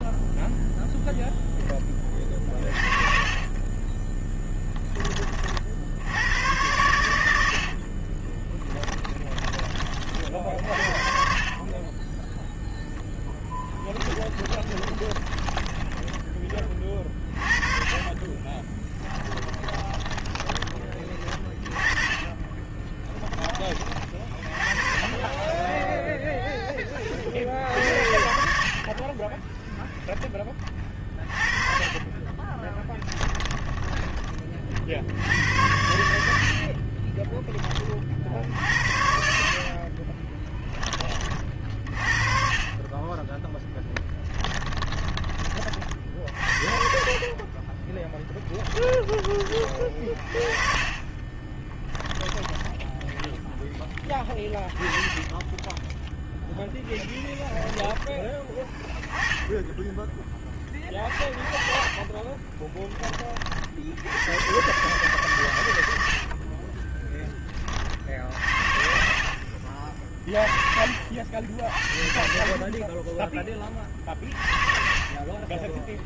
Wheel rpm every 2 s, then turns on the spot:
0, 30, 20, 110, 20, 70, 0, 20, 20, 20, 20, 20, 30, 10, 50, 20, 20, 40, 60, 70, 20, 10, 10, 50, 10, 30, 10, 10, 10, 10, 30, 20, 130, 20, 60, 60, 10, 30.
2-6 8-10 14-16 18-20 22-24 32-34 36-38 44-52 56-58 66-70 72-74